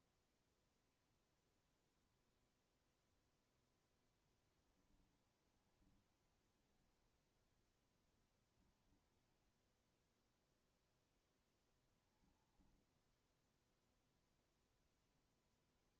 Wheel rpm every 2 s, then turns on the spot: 0, 0, 20, 10, 10, 0, 10, 0.
4-10 12-14